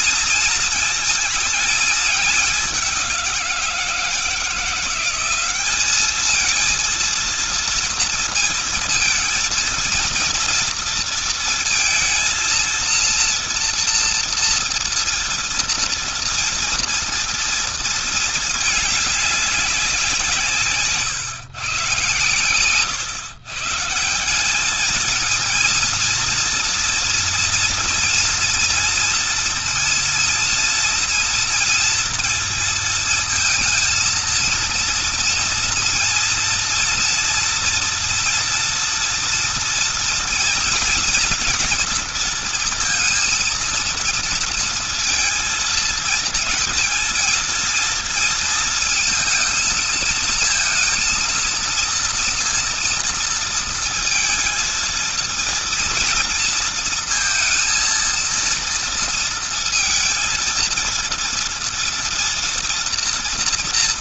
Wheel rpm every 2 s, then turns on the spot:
230, 200, 180, 230, 220, 230, 230, 230, 230, 210, 160, 120, 210, 230, 230, 230, 230, 230, 230, 230, 230, 230, 230, 230, 230, 230, 230, 230, 230, 230, 230, 230.
none